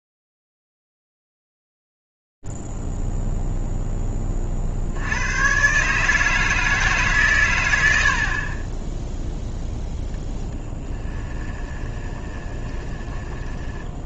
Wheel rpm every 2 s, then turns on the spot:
0, 0, 10, 150, 80, 0, 20.
12-14